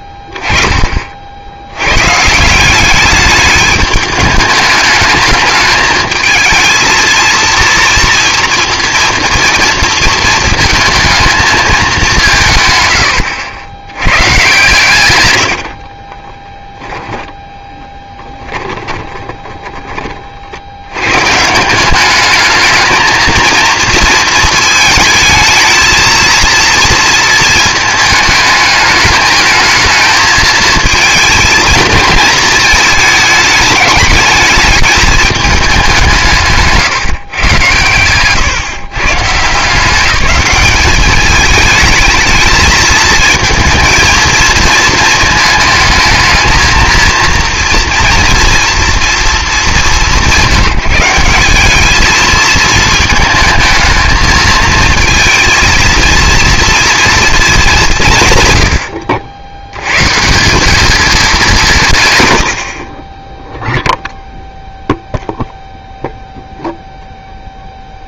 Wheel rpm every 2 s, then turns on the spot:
20, 190, 210, 220, 230, 220, 110, 120, 20, 20, 80, 210, 220, 230, 220, 220, 220, 220, 150, 140, 200, 220, 220, 230, 240, 170, 220, 230, 230, 100, 210, 60, 0, 0.
16-20